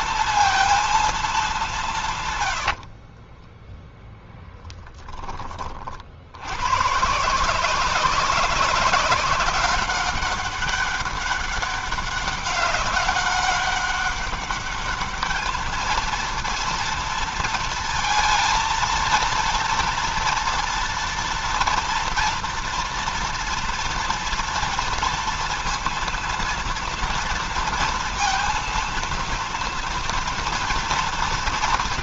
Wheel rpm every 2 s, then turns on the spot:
230, 90, 20, 100, 190, 200, 200, 200, 230, 230, 230, 230, 230, 230, 230, 230.
2-6